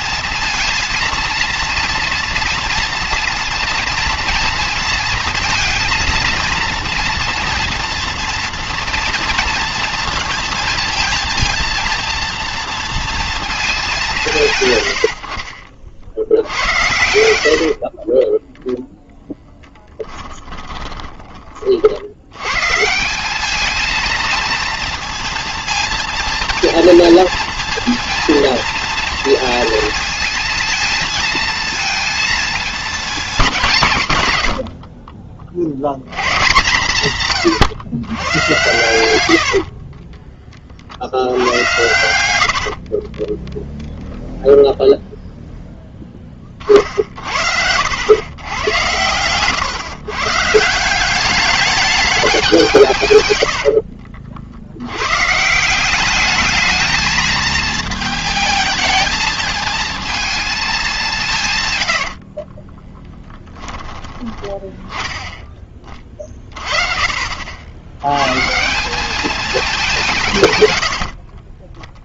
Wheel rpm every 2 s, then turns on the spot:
230, 230, 230, 230, 230, 230, 230, 130, 70, 0, 20, 130, 230, 230, 230, 230, 230, 80, 140, 110, 30, 80, 0, 40, 110, 150, 190, 70, 220, 220, 220, 30, 20, 40, 160, 120.
20-22 42-44 62-64 70-72